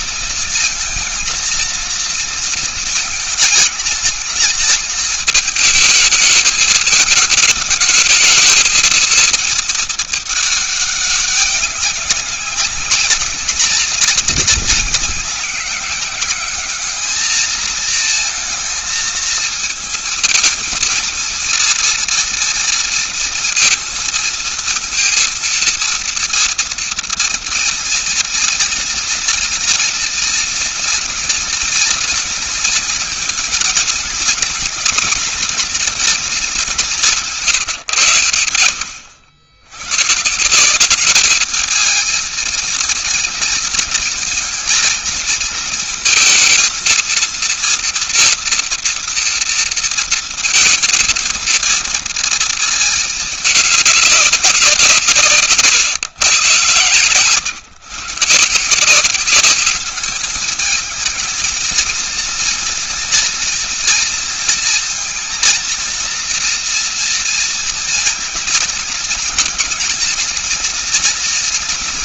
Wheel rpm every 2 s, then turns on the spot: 230, 230, 210, 220, 220, 210, 200, 190, 200, 220, 220, 230, 230, 230, 230, 240, 230, 240, 220, 110, 160, 220, 220, 220, 230, 230, 230, 190, 130, 150, 220, 230, 230, 230, 220, 230.
none